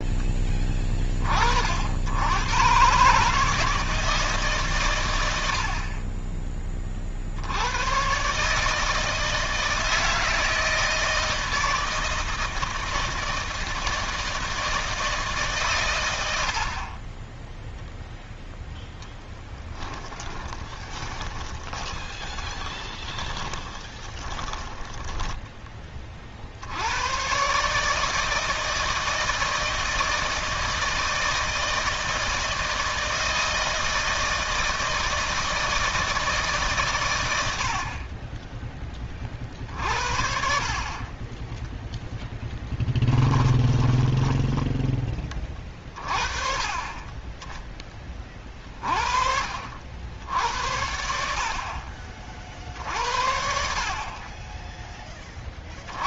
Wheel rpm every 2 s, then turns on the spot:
20, 130, 130, 30, 150, 160, 160, 160, 60, 0, 10, 20, 10, 70, 160, 160, 160, 160, 140, 20, 40, 20, 20, 30, 30, 70, 50, 20.
20-26 42-46